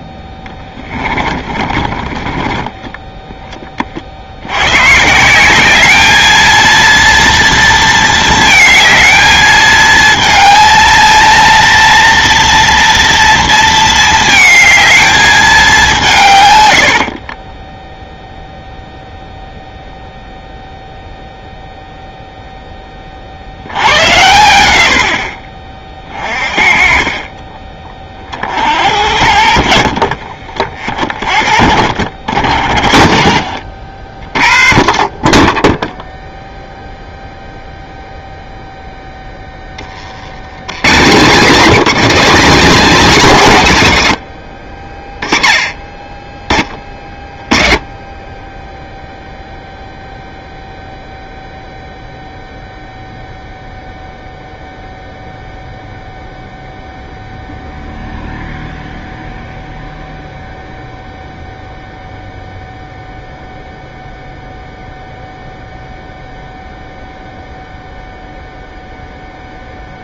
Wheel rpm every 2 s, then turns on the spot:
10, 20, 100, 230, 220, 230, 230, 220, 110, 0, 0, 10, 90, 40, 50, 40, 50, 40, 0, 0, 110, 270, 60, 20, 10, 0, 0, 0, 0, 0, 0, 0, 0, 0, 0.
0-2